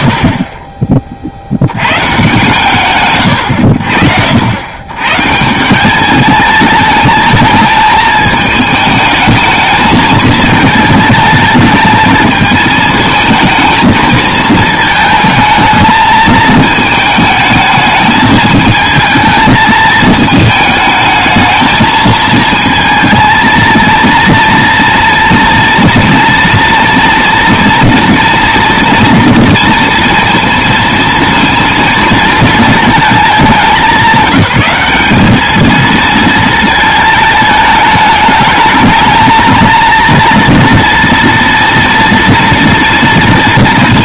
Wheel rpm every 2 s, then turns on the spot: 20, 100, 90, 220, 220, 220, 220, 220, 220, 220, 220, 220, 230, 230, 230, 230, 230, 190, 220, 220, 230, 230.
none